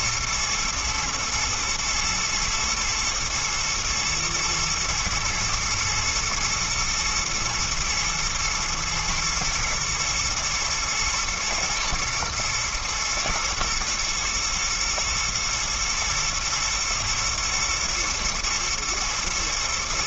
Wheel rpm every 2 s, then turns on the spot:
120, 110, 110, 120, 110, 110, 120, 110, 120, 120.
none